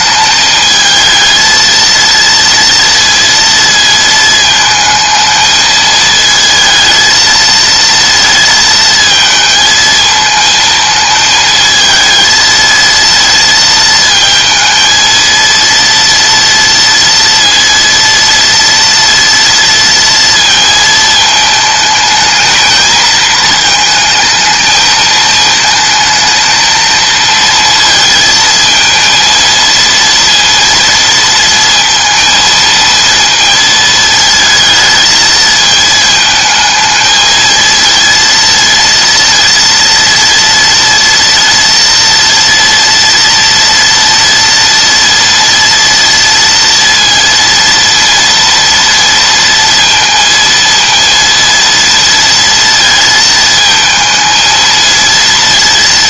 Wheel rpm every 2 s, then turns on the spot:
220, 230, 220, 220, 220, 220, 230, 230, 230, 230, 220, 220, 220, 220, 220, 230, 230, 220, 220, 230, 230, 230, 230, 230, 230, 230, 230, 230.
none